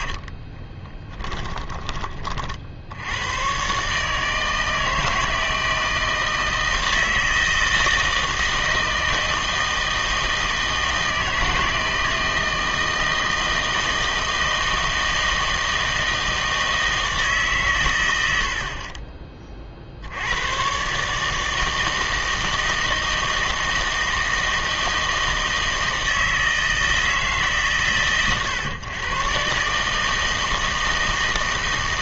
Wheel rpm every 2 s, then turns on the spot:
20, 70, 160, 160, 160, 160, 160, 160, 160, 50, 120, 160, 160, 160, 120, 160.
0-2